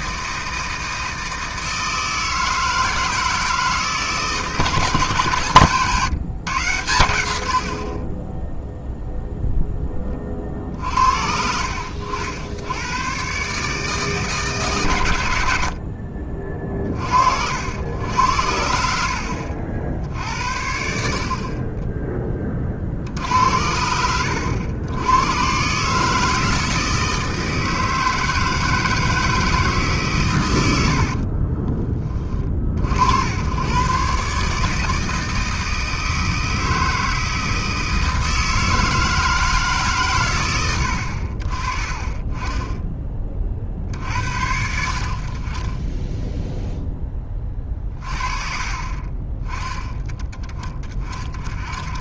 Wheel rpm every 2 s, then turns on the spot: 160, 160, 160, 110, 0, 50, 90, 140, 30, 70, 80, 40, 100, 160, 160, 90, 40, 150, 160, 160, 90, 20, 60, 0, 40, 30.
18-20 30-32 48-50